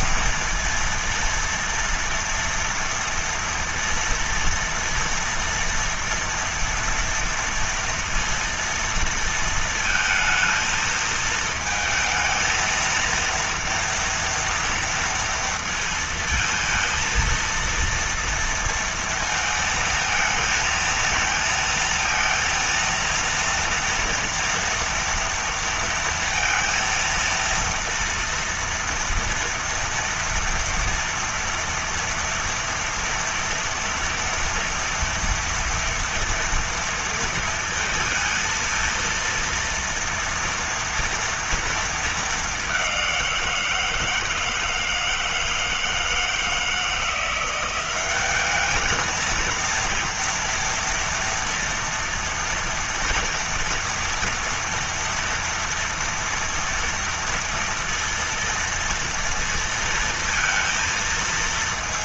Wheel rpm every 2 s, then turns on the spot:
230, 230, 230, 230, 230, 220, 220, 240, 230, 230, 220, 230, 230, 230, 230, 230, 230, 230, 230, 230, 230, 210, 160, 160, 200, 230, 230, 230, 230, 230, 230.
none